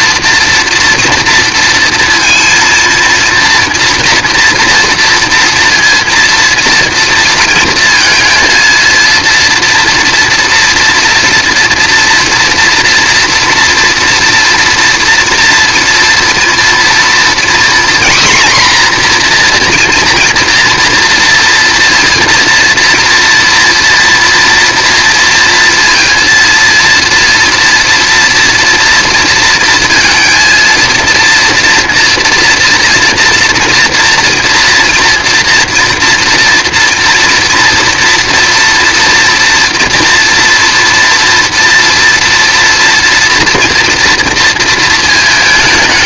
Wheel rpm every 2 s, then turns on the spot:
230, 230, 230, 230, 230, 230, 230, 230, 240, 250, 240, 230, 230, 230, 230, 230, 240, 230, 230, 230, 230, 230, 230.
none